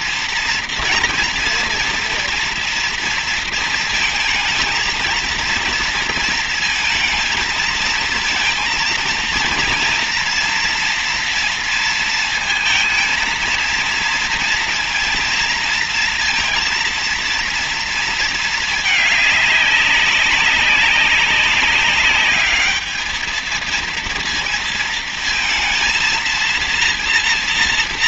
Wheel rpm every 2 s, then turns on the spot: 240, 230, 230, 230, 230, 230, 230, 230, 230, 220, 200, 210, 230, 230.
none